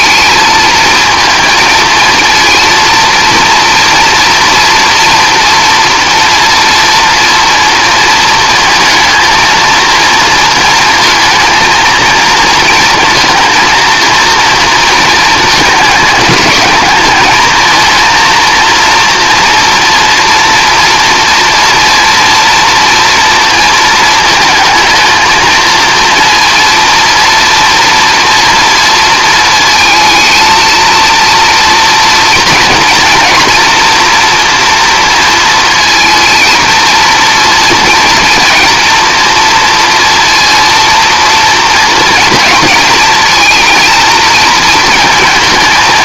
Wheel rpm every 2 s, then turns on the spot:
220, 230, 230, 230, 220, 230, 230, 230, 210, 230, 230, 230, 220, 230, 230, 220, 230, 230, 230, 230, 230, 230, 230.
none